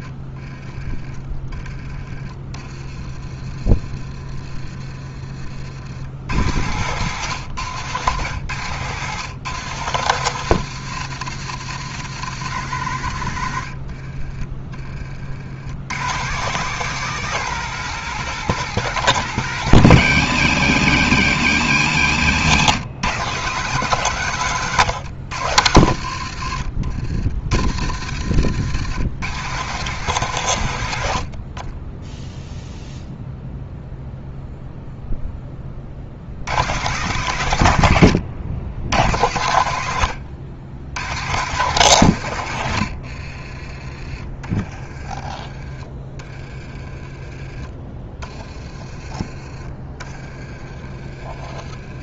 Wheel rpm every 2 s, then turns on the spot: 20, 20, 30, 120, 120, 160, 120, 30, 170, 180, 130, 120, 120, 60, 110, 90, 0, 0, 120, 110, 110, 80, 40, 30, 20, 30.
6-8 26-28 42-48 50-52